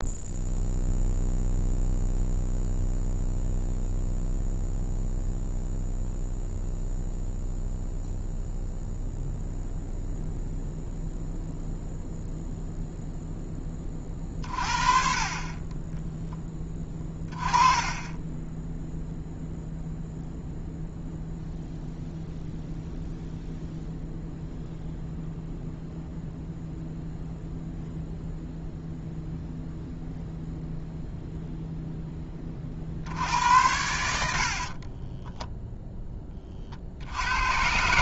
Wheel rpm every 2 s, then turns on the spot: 0, 0, 0, 0, 0, 0, 0, 40, 10, 10, 0, 0, 0, 0, 0, 0, 30, 50, 40.
16-20 34-36